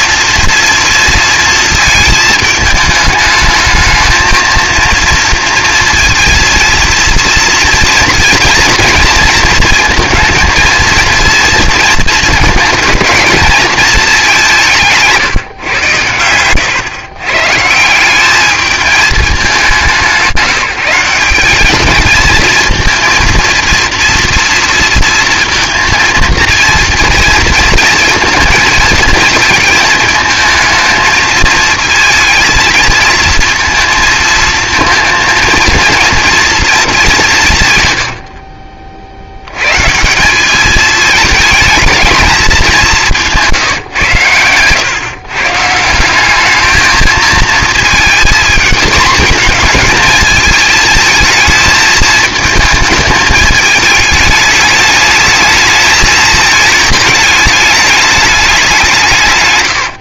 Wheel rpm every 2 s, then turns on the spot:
230, 210, 220, 230, 230, 230, 230, 170, 120, 210, 190, 220, 230, 230, 220, 230, 220, 230, 220, 50, 210, 200, 120, 220, 220, 220, 220, 210, 220, 190.
none